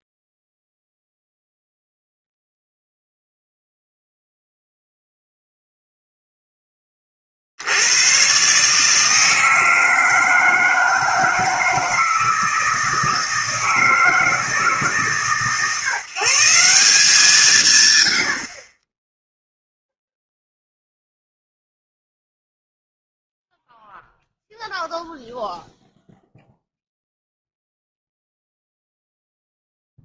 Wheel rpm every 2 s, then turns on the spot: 0, 0, 0, 20, 150, 160, 160, 150, 180, 20, 0, 0, 0, 0, 0.
none